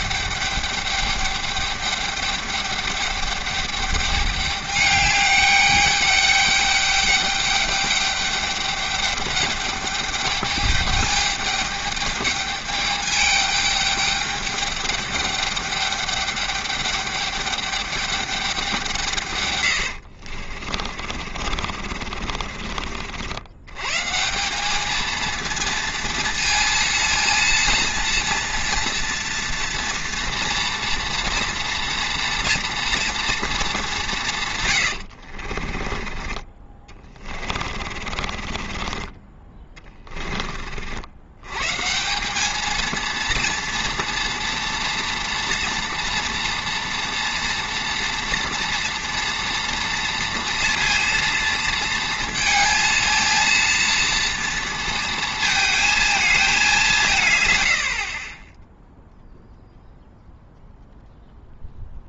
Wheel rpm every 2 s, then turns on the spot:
210, 210, 200, 200, 210, 210, 210, 210, 210, 190, 40, 50, 190, 230, 230, 240, 230, 130, 30, 40, 40, 220, 230, 240, 240, 230, 220, 230, 200, 10, 0.
20-24 34-36 38-40